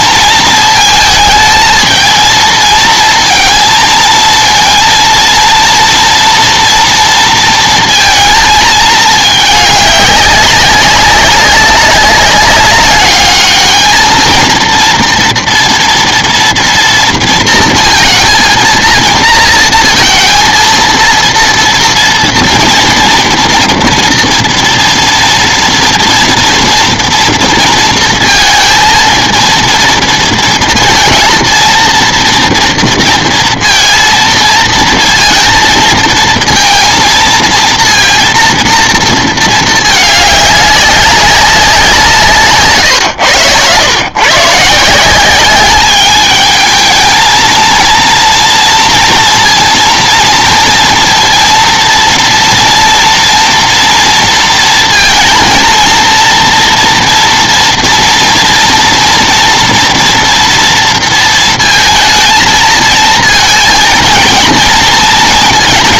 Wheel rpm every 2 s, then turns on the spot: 220, 230, 230, 230, 220, 200, 200, 230, 230, 230, 230, 230, 230, 230, 230, 220, 230, 230, 230, 230, 210, 140, 140, 220, 230, 230, 230, 230, 240, 230, 230, 230, 230.
none